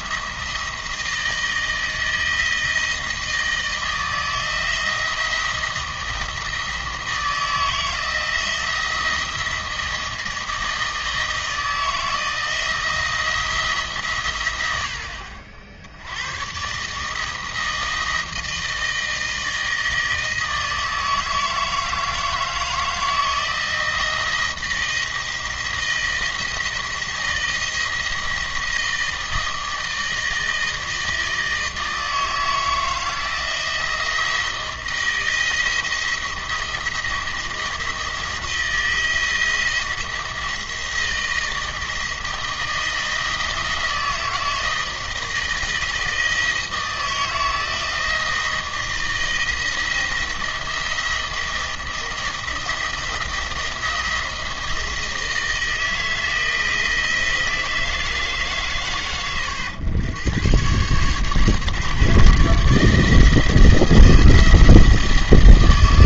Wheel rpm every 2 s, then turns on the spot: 170, 160, 170, 160, 170, 160, 170, 90, 140, 160, 160, 160, 170, 170, 160, 160, 160, 170, 170, 170, 170, 160, 160, 160, 160, 170, 170, 160, 160, 130, 120, 150, 160.
none